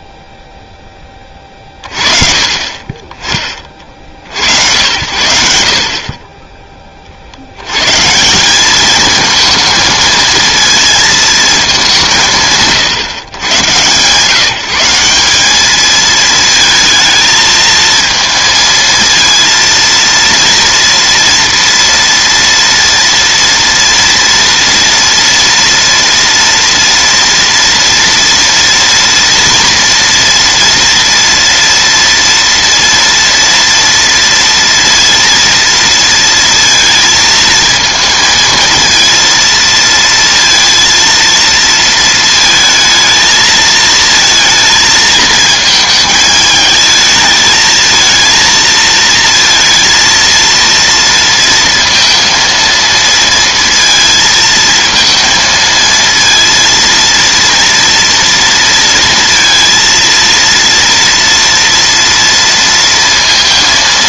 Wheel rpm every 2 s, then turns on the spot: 20, 30, 90, 50, 220, 220, 130, 190, 220, 230, 230, 230, 230, 230, 230, 240, 240, 230, 230, 230, 230, 220, 220, 220, 230, 230, 230, 230, 230, 230, 230, 230.
none